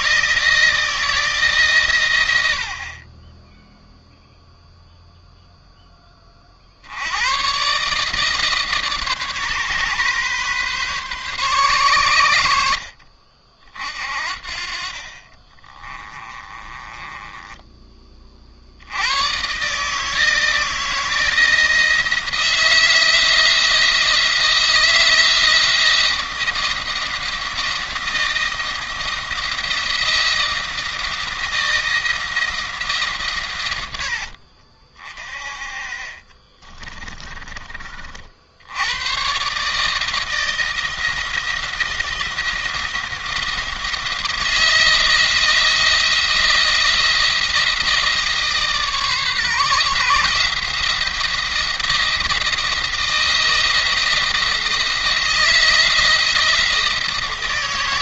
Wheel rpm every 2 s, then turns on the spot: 160, 50, 0, 50, 150, 130, 70, 50, 20, 80, 160, 160, 170, 170, 160, 160, 160, 50, 30, 70, 160, 170, 160, 170, 150, 160, 170, 170, 170.
14-18 36-38